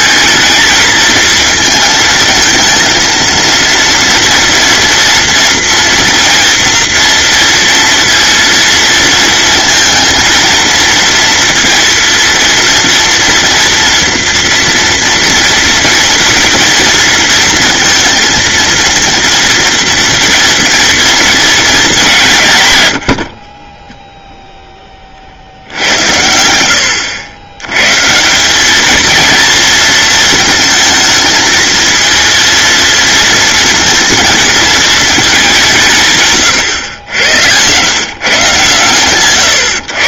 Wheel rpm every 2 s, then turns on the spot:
220, 230, 230, 230, 230, 230, 230, 230, 230, 230, 230, 120, 30, 90, 230, 220, 230, 220, 100, 120.
none